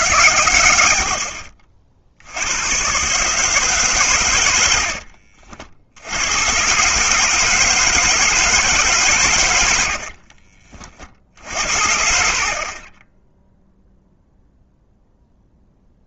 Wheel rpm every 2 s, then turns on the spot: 110, 100, 90, 110, 160, 40, 40, 0.
10-12